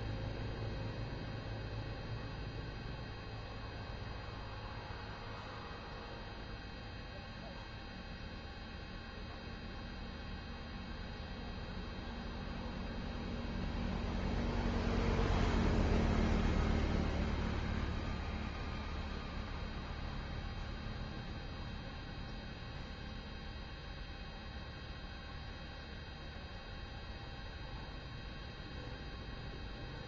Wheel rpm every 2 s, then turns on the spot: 0, 0, 0, 0, 0, 0, 0, 0, 0, 0, 0, 0, 0, 0, 0.
none